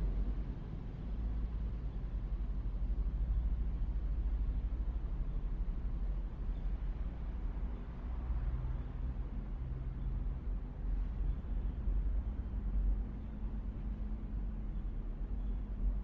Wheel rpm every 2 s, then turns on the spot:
0, 0, 0, 0, 0, 0, 0, 0.
none